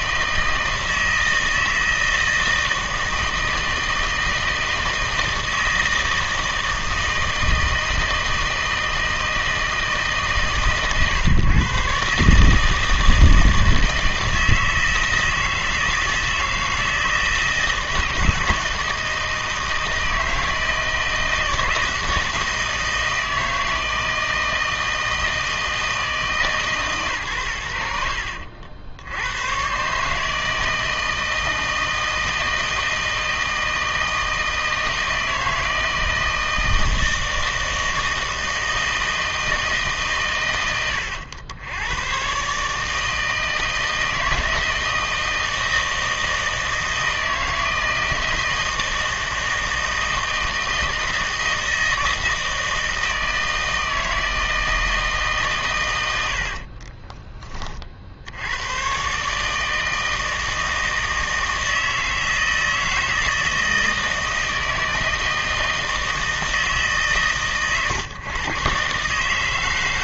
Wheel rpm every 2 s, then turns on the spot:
160, 160, 160, 160, 160, 140, 160, 160, 160, 160, 160, 160, 160, 140, 70, 160, 160, 160, 160, 160, 110, 150, 160, 160, 160, 160, 160, 160, 30, 110, 160, 160, 160, 150, 130.
56-58